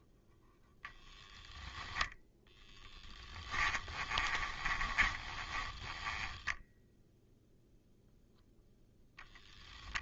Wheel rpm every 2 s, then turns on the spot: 0, 10, 20, 0, 10.
2-6